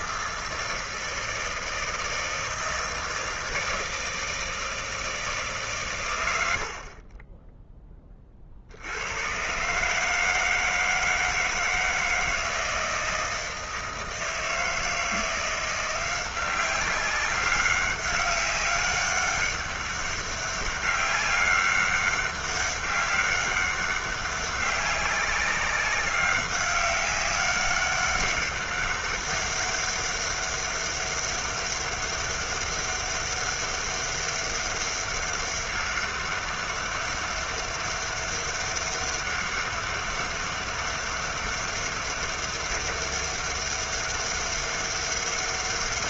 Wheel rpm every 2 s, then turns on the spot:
160, 160, 160, 70, 60, 160, 160, 160, 190, 200, 200, 200, 200, 200, 200, 200, 200, 200, 200, 200, 200, 200, 200.
none